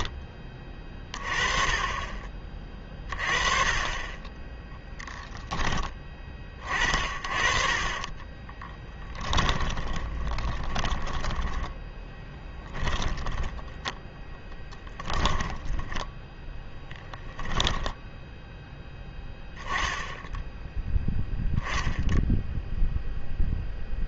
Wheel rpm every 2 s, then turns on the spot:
20, 30, 10, 30, 20, 20, 10, 10, 10, 10, 0, 0.
8-18